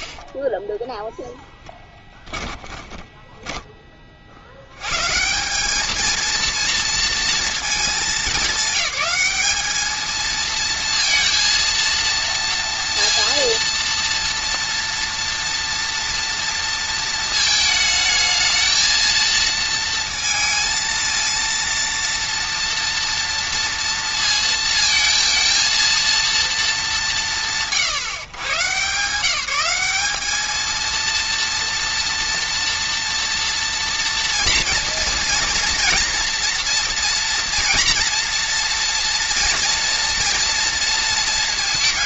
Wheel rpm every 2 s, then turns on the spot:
10, 10, 80, 230, 200, 230, 230, 230, 230, 220, 230, 230, 220, 220, 140, 220, 230, 230, 230, 230, 230.
2-4